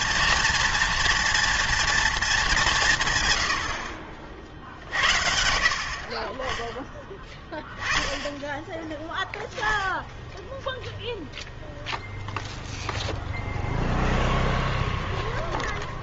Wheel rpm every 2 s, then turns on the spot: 230, 180, 40, 10, 10, 0, 0, 10.
14-16